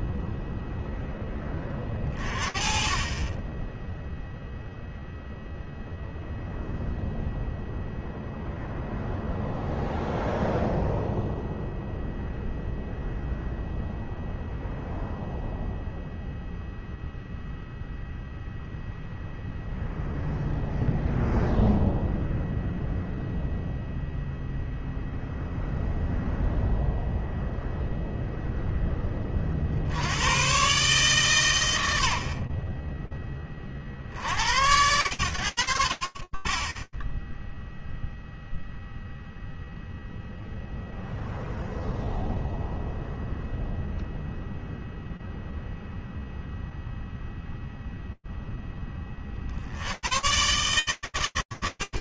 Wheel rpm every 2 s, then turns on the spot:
0, 30, 0, 0, 0, 0, 0, 0, 0, 0, 0, 0, 0, 0, 20, 120, 50, 80, 10, 0, 0, 0, 0, 0, 100, 100.
none